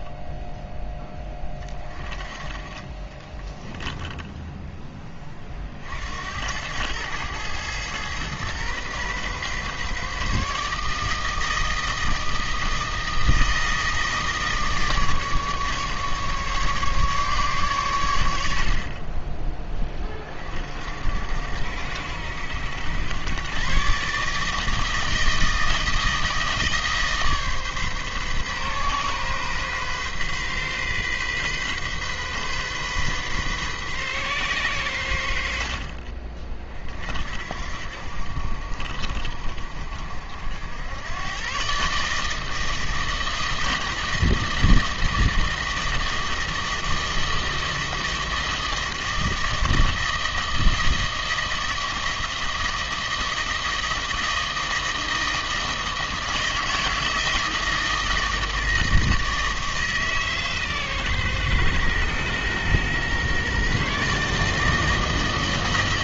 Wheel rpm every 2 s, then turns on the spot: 10, 30, 10, 100, 120, 150, 160, 150, 150, 60, 50, 90, 160, 160, 130, 130, 130, 120, 40, 60, 80, 160, 160, 160, 160, 160, 160, 160, 160, 160, 140, 120, 160.
none